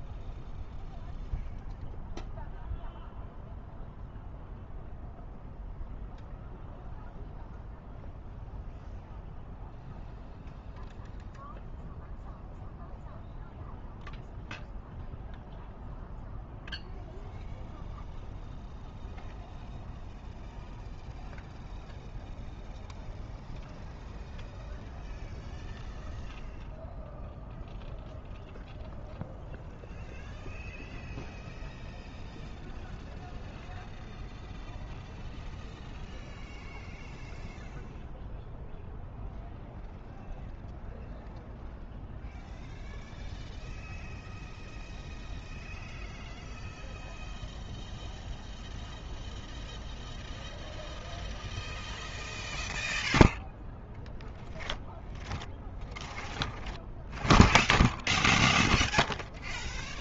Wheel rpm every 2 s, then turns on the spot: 0, 0, 0, 0, 0, 0, 0, 0, 0, 0, 0, 0, 0, 0, 0, 0, 0, 0, 0, 0, 0, 0, 0, 0, 0, 0, 0, 0, 0, 0.
none